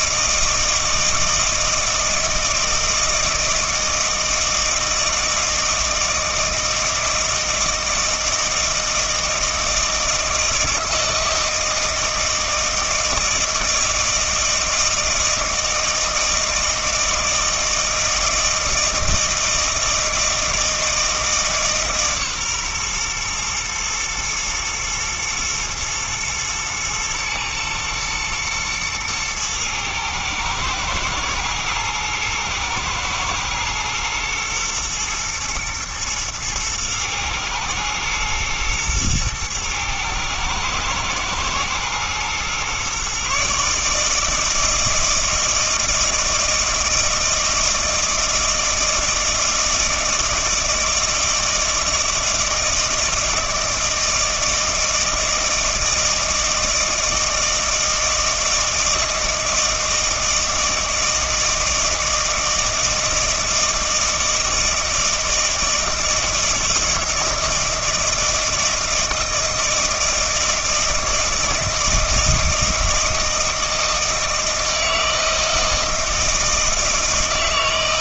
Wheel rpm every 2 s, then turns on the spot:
160, 160, 160, 160, 160, 160, 160, 160, 160, 160, 160, 130, 110, 110, 110, 110, 110, 120, 110, 120, 110, 120, 160, 160, 160, 160, 160, 160, 160, 160, 160, 160, 160, 160, 160, 160, 160, 160, 160.
none